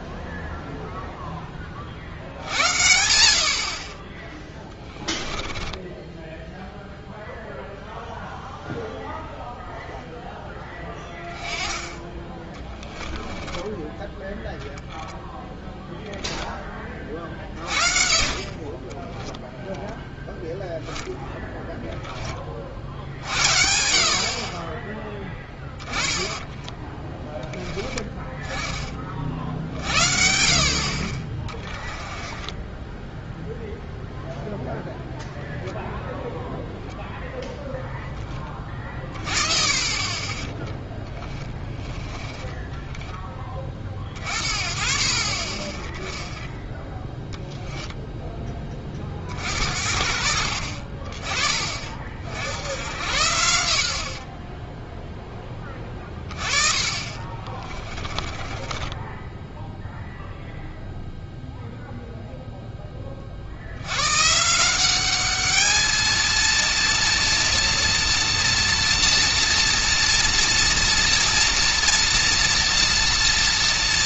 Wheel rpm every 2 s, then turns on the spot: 0, 50, 10, 0, 0, 10, 10, 0, 30, 20, 0, 50, 10, 10, 40, 40, 10, 0, 0, 30, 10, 20, 40, 10, 30, 40, 80, 0, 30, 10, 0, 20, 190, 230, 230, 230, 230.
4-6 12-14 18-20 32-34 40-44 56-60